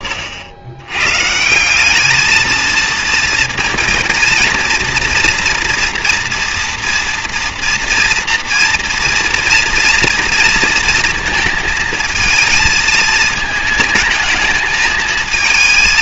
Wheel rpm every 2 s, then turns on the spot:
110, 230, 230, 230, 230, 230, 220, 220.
none